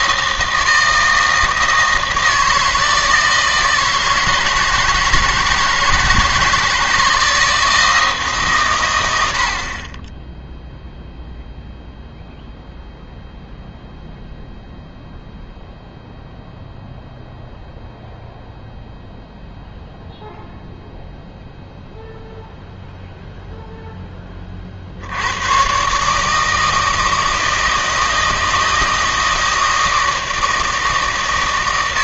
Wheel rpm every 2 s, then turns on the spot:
160, 160, 160, 170, 120, 0, 0, 0, 0, 0, 0, 0, 50, 160, 160, 160.
none